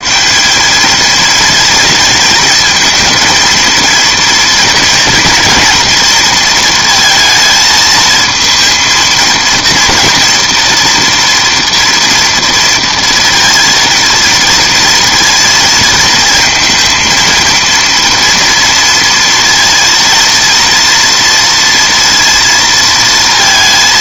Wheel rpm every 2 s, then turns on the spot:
210, 230, 230, 230, 230, 230, 230, 230, 230, 230, 230, 230.
none